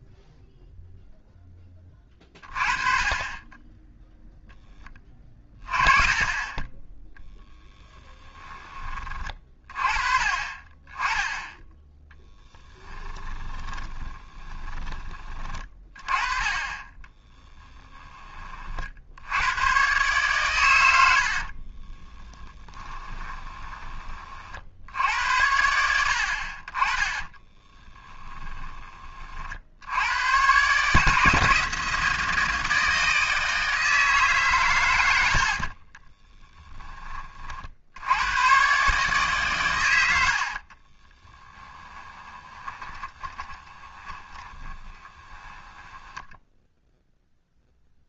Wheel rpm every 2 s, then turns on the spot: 0, 40, 10, 20, 20, 30, 20, 10, 30, 50, 100, 20, 60, 40, 20, 140, 160, 120, 20, 130, 40, 20, 30, 0.
12-14 22-24 40-46